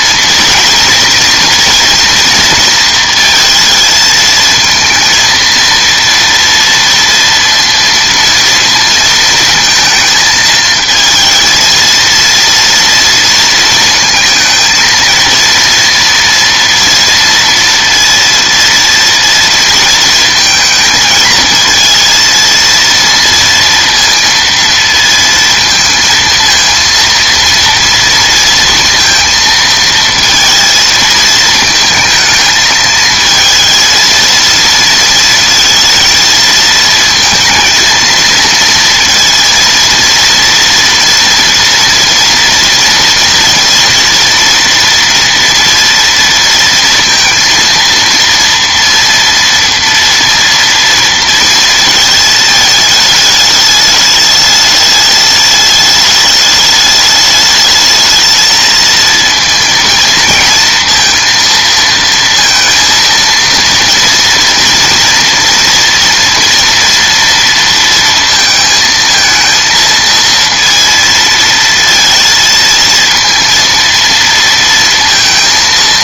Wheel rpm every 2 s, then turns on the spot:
230, 230, 220, 230, 230, 220, 230, 230, 230, 230, 220, 230, 230, 230, 230, 230, 220, 230, 230, 230, 230, 230, 230, 230, 230, 230, 220, 210, 210, 230, 230, 230, 230, 230, 220, 230, 230, 230.
none